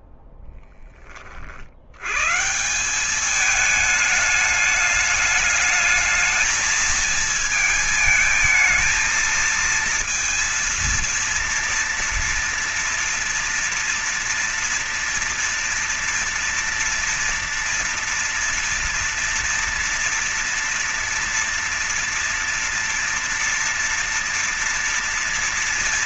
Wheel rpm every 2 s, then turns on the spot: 10, 140, 210, 220, 220, 230, 230, 230, 230, 230, 230, 230, 230.
none